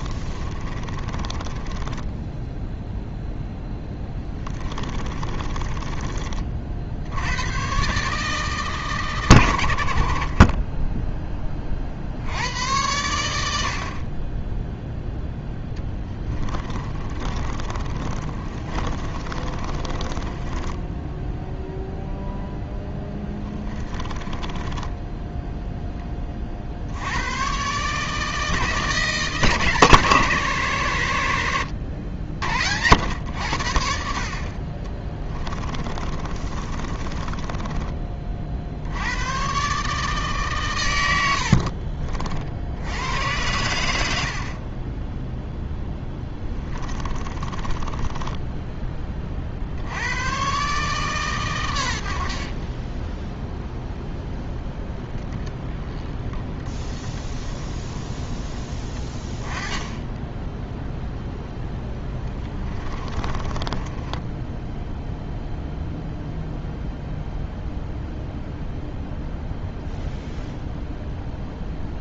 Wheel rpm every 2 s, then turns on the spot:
20, 0, 20, 60, 130, 10, 90, 0, 20, 30, 10, 0, 10, 60, 160, 130, 90, 40, 30, 60, 120, 80, 30, 20, 10, 140, 30, 10, 10, 20, 0, 20, 10, 0, 0, 0.
0-2 4-6 16-22 24-26 36-38 44-48 62-66